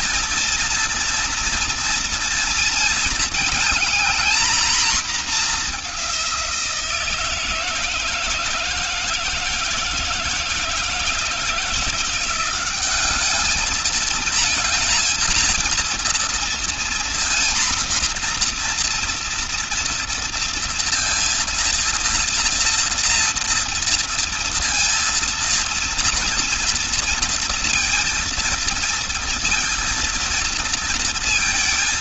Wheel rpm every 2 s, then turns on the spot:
230, 230, 220, 160, 160, 160, 210, 230, 240, 240, 230, 230, 230, 230, 230, 220.
none